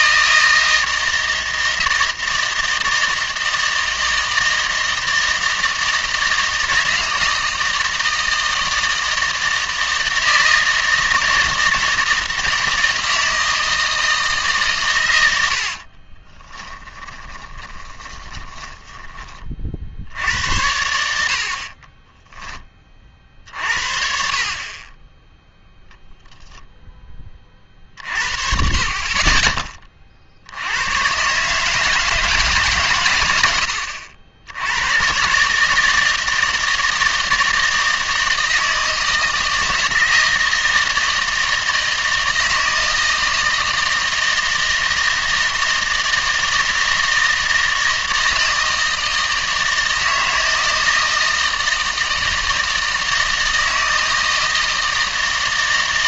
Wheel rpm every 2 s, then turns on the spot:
160, 160, 160, 160, 160, 160, 160, 130, 10, 20, 80, 20, 30, 0, 40, 80, 150, 90, 160, 160, 160, 160, 160, 160, 160, 160, 160, 160.
16-20